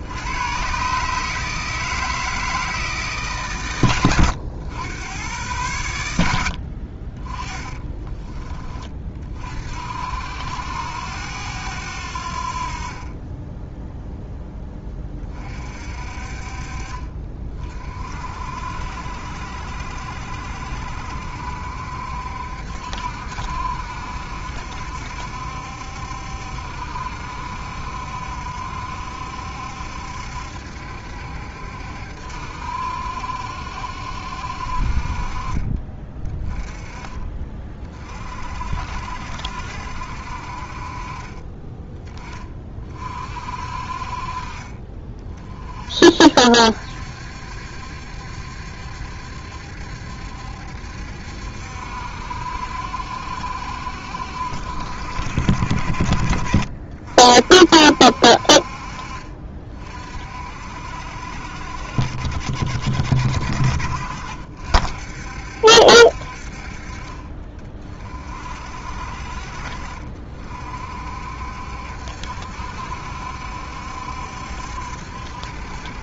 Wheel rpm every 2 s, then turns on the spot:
120, 160, 90, 60, 30, 80, 50, 10, 40, 60, 70, 70, 70, 70, 70, 70, 70, 60, 20, 60, 50, 30, 40, 60, 70, 70, 70, 60, 60, 50, 60, 60, 60, 50, 50, 50, 70, 70.
none